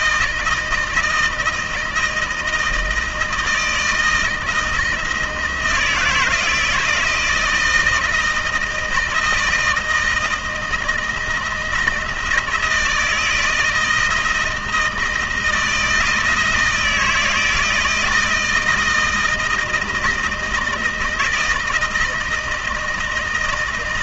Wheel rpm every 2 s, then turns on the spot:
160, 160, 170, 160, 160, 160, 160, 160, 160, 160, 160, 160.
none